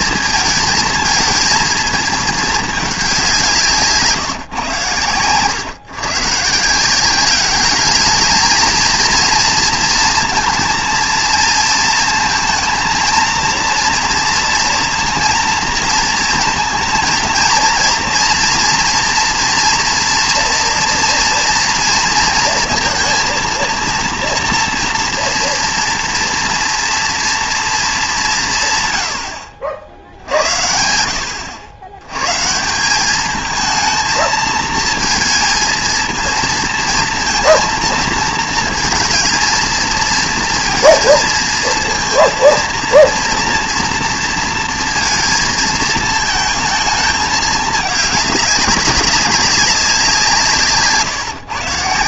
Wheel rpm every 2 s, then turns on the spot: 220, 210, 130, 150, 230, 230, 220, 230, 230, 230, 230, 230, 230, 230, 150, 70, 160, 220, 230, 220, 230, 230, 230, 220, 200, 160.
none